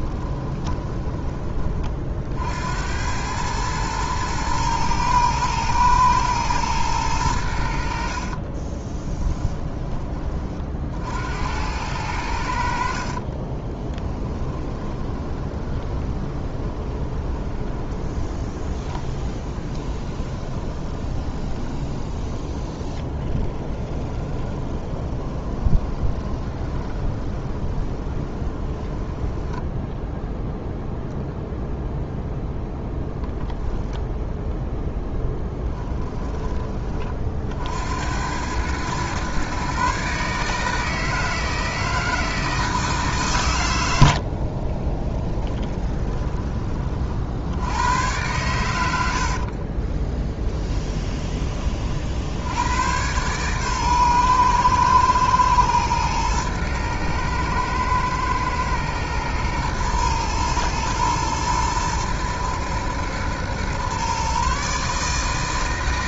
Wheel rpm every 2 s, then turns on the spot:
20, 80, 110, 110, 30, 50, 60, 20, 20, 20, 20, 30, 20, 20, 20, 0, 0, 0, 30, 110, 150, 160, 30, 30, 90, 10, 90, 120, 110, 120, 110, 110, 140.
0-2 8-10 14-30 44-46 50-52